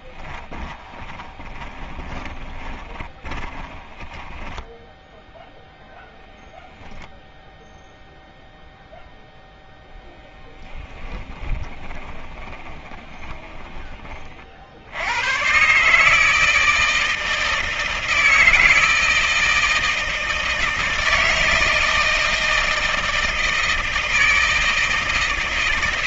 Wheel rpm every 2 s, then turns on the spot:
20, 20, 10, 0, 0, 10, 20, 60, 160, 160, 160, 160, 160.
0-6 10-14